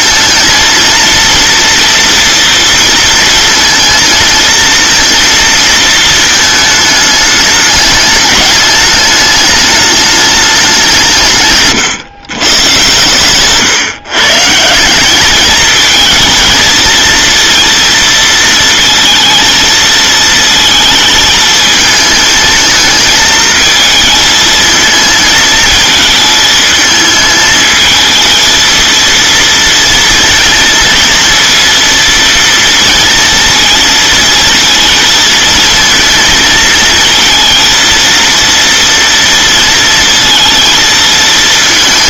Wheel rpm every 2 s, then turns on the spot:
230, 230, 230, 220, 210, 190, 130, 170, 220, 230, 220, 220, 220, 220, 230, 230, 230, 230, 220, 230, 230.
none